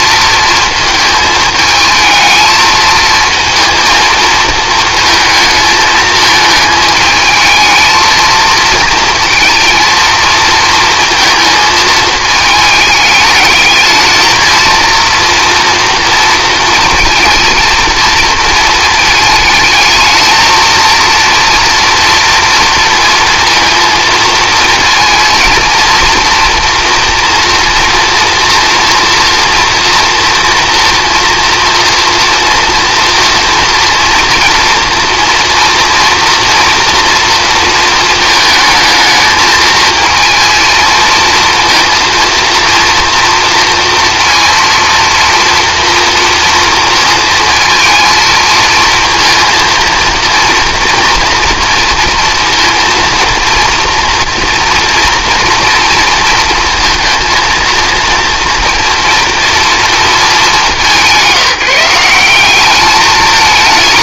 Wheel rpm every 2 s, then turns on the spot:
220, 230, 220, 220, 230, 230, 210, 230, 220, 220, 230, 230, 230, 230, 230, 230, 230, 230, 230, 220, 230, 230, 230, 230, 220, 230, 230, 230, 220, 230, 190, 200.
none